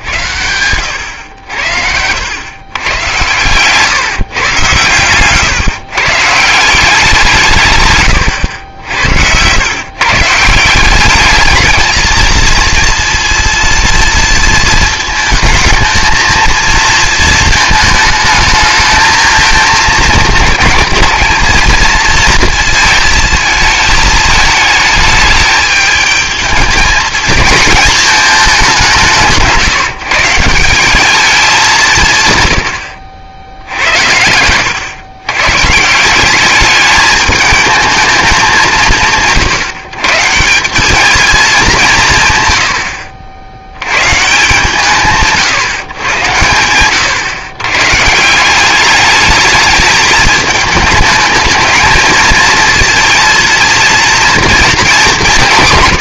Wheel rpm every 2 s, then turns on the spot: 100, 110, 130, 170, 100, 170, 230, 230, 220, 220, 210, 230, 220, 220, 210, 180, 110, 100, 200, 180, 180, 110, 170, 100, 180, 210, 220, 230.
8-10